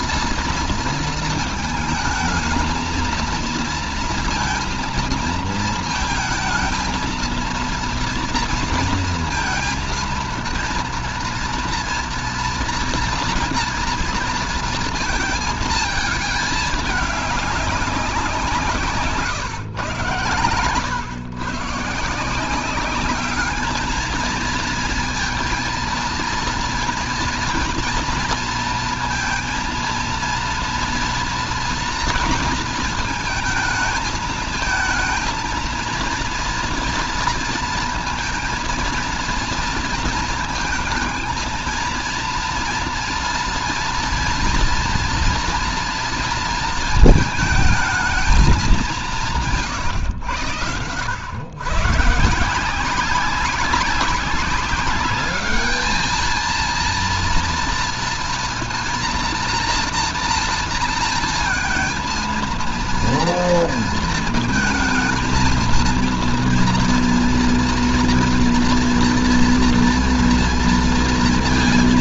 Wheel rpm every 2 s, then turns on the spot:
230, 220, 230, 230, 230, 230, 230, 230, 210, 170, 120, 180, 230, 230, 230, 230, 230, 220, 230, 230, 220, 230, 230, 230, 210, 110, 170, 200, 230, 230, 230, 230, 230, 230, 230, 230.
none